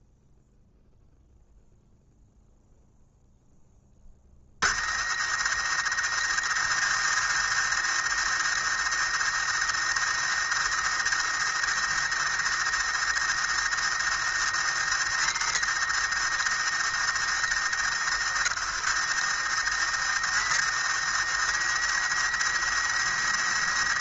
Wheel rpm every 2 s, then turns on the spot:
0, 0, 50, 110, 110, 110, 110, 110, 110, 100, 110, 110.
none